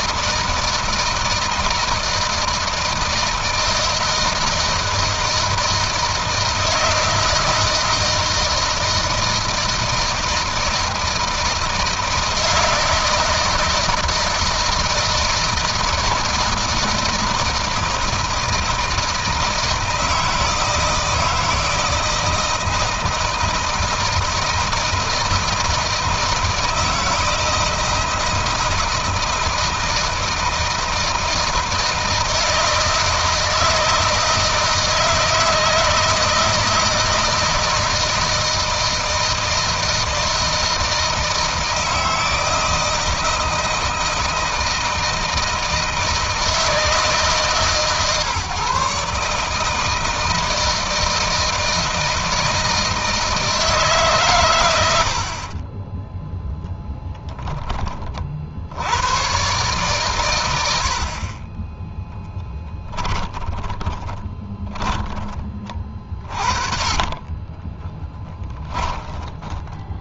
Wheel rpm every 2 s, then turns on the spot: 160, 160, 160, 160, 160, 160, 160, 160, 160, 160, 160, 160, 160, 160, 160, 160, 160, 160, 160, 160, 160, 160, 160, 160, 150, 160, 160, 100, 10, 70, 80, 10, 20, 30, 10.
62-66 68-70